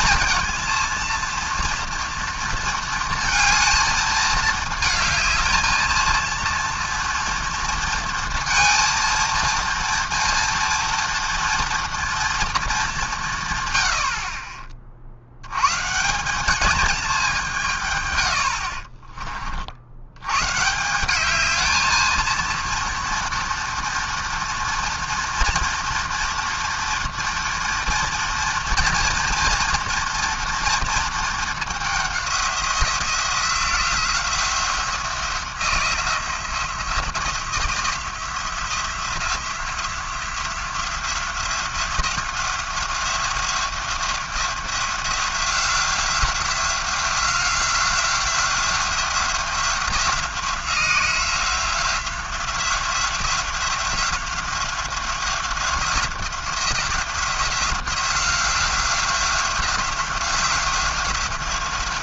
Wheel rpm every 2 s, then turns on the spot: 230, 230, 220, 230, 230, 230, 210, 40, 210, 60, 170, 230, 230, 230, 230, 230, 180, 170, 170, 170, 180, 180, 180, 180, 180, 180, 180, 180, 180, 180, 180.
18-20